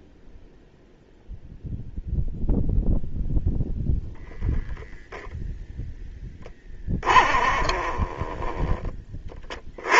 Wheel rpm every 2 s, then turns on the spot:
0, 0, 0, 20, 30.
6-8